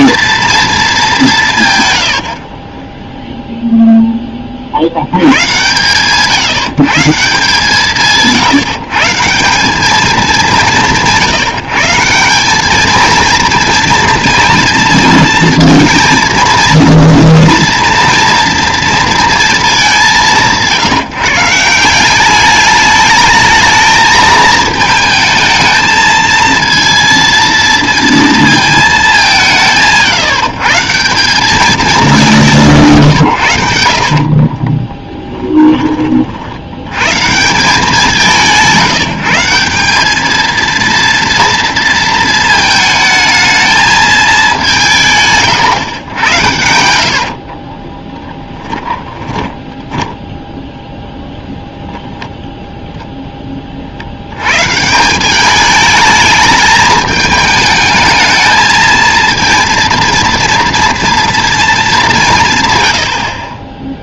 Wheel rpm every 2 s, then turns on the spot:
220, 20, 70, 150, 160, 190, 210, 230, 230, 230, 160, 210, 220, 230, 220, 160, 160, 20, 100, 180, 230, 220, 170, 90, 20, 0, 0, 130, 210, 230, 230, 120.
2-4 34-36 46-50